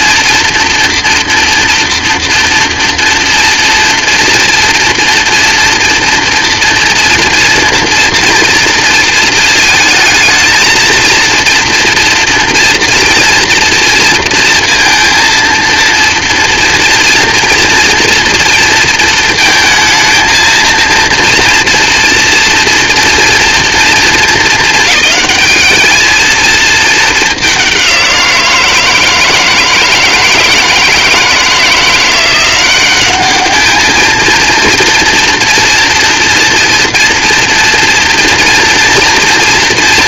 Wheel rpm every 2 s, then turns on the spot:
240, 230, 230, 240, 230, 230, 230, 230, 230, 230, 230, 230, 210, 210, 160, 160, 190, 230, 230, 230.
none